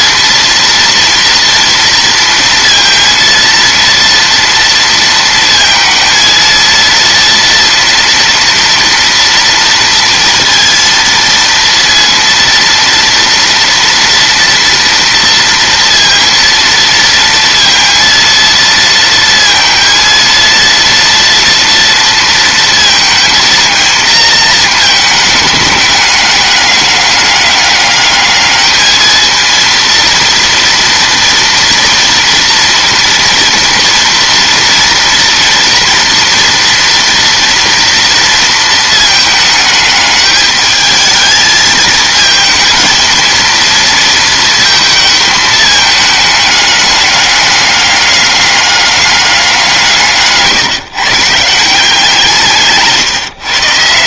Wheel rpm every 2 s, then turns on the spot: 230, 230, 230, 230, 230, 230, 230, 230, 230, 230, 230, 230, 220, 200, 220, 230, 230, 230, 230, 230, 220, 230, 220, 210, 200, 160, 150.
none